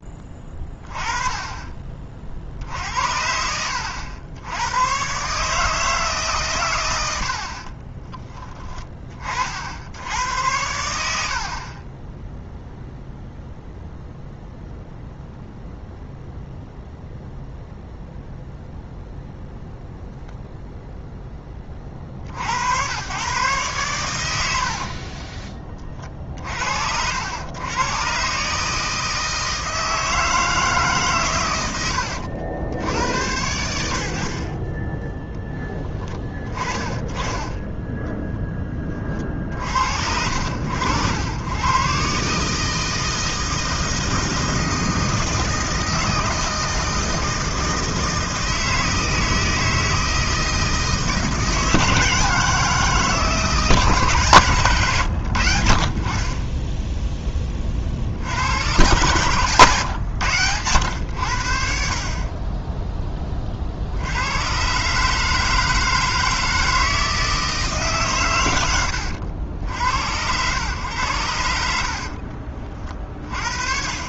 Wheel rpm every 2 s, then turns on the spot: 20, 60, 100, 110, 20, 80, 0, 0, 0, 0, 0, 90, 60, 60, 150, 150, 90, 20, 20, 20, 80, 160, 160, 160, 160, 160, 160, 130, 10, 100, 110, 10, 130, 160, 100, 110, 40.
24-26 54-56